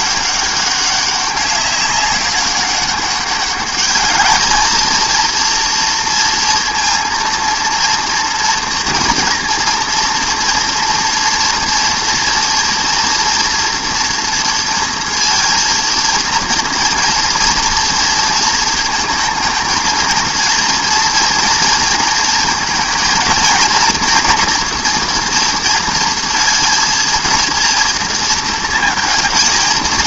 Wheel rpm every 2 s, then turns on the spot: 200, 190, 220, 230, 230, 230, 230, 230, 230, 230, 230, 230, 240, 230, 230.
none